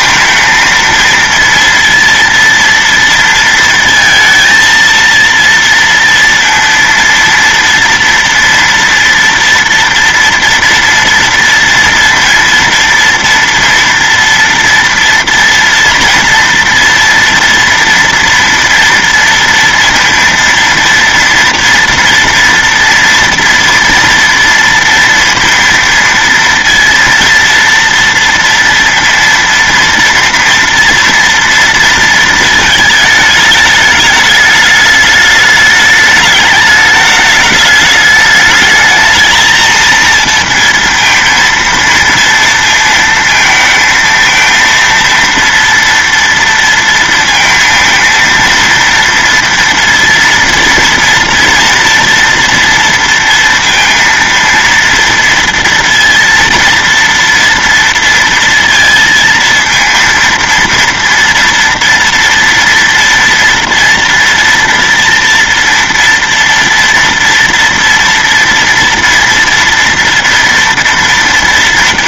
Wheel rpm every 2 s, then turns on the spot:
230, 230, 230, 230, 230, 230, 230, 230, 230, 230, 230, 230, 230, 230, 230, 240, 220, 210, 210, 220, 230, 230, 230, 230, 230, 230, 230, 230, 230, 230, 230, 230, 230, 230, 230, 230.
none